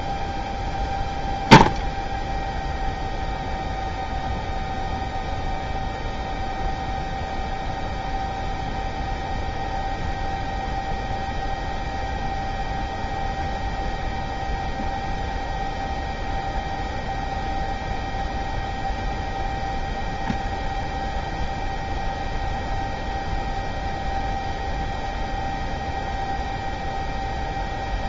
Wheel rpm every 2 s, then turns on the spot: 0, 0, 0, 0, 0, 0, 0, 0, 0, 0, 0, 0, 0, 0.
none